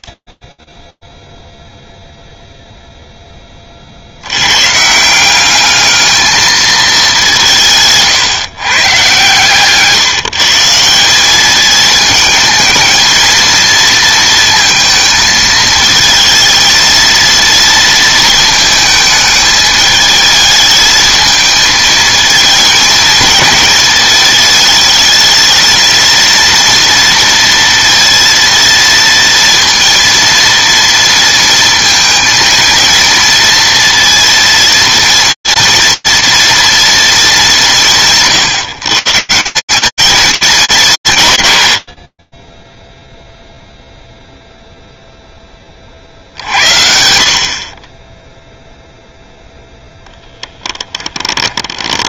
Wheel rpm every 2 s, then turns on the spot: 30, 0, 140, 210, 130, 170, 230, 230, 230, 220, 220, 220, 220, 230, 230, 230, 230, 230, 230, 150, 200, 10, 0, 70, 0, 20.
50-52